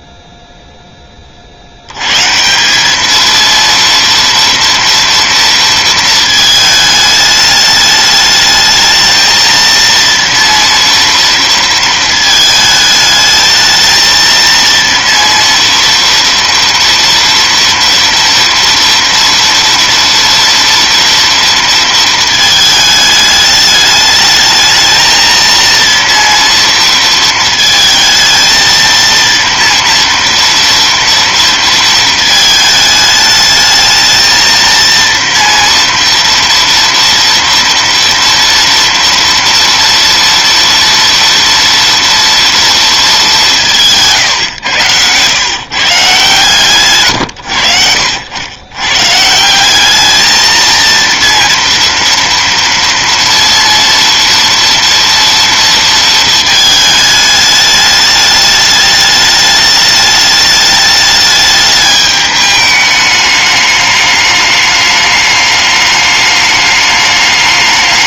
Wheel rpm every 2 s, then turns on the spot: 20, 210, 230, 210, 220, 230, 220, 230, 230, 230, 230, 210, 220, 230, 230, 230, 220, 230, 230, 230, 230, 210, 110, 110, 140, 230, 230, 230, 210, 210, 210, 210, 210, 210.
none